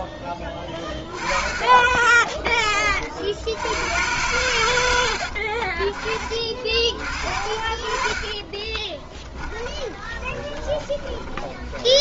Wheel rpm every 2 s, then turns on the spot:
20, 30, 100, 40, 30, 20.
0-2 8-12